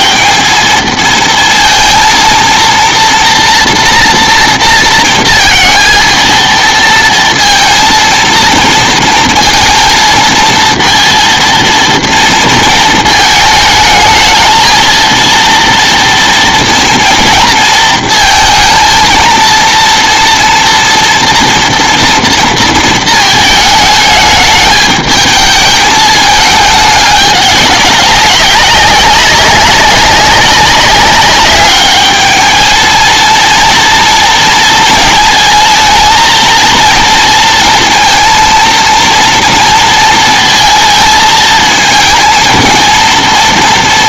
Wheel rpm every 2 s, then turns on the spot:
220, 230, 230, 230, 230, 230, 230, 220, 230, 230, 230, 230, 210, 210, 200, 200, 230, 230, 230, 230, 220, 230.
none